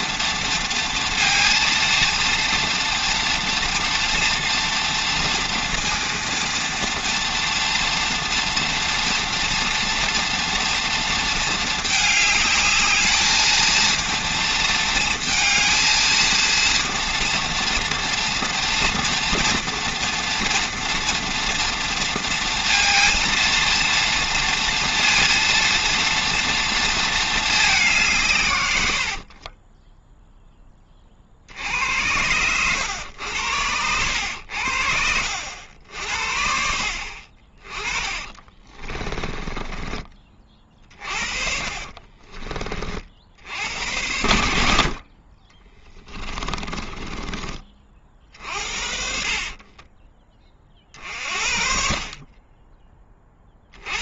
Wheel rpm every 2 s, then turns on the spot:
230, 240, 240, 230, 240, 230, 210, 230, 230, 240, 230, 230, 230, 230, 110, 20, 100, 70, 60, 30, 40, 40, 60, 20, 60, 40, 20.
28-30 38-40 46-50